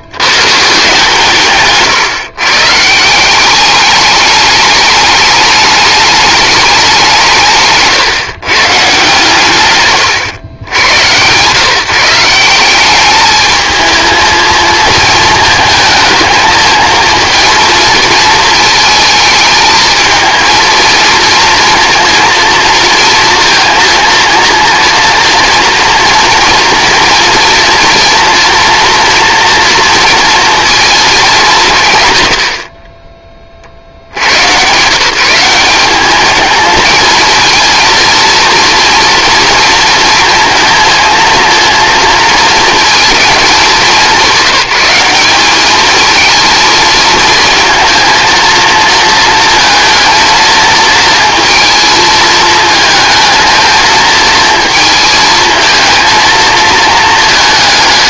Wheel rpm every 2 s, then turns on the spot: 130, 140, 210, 200, 150, 100, 180, 230, 220, 220, 230, 230, 230, 230, 230, 230, 50, 120, 220, 240, 230, 230, 200, 220, 230, 230, 220, 230, 220.
none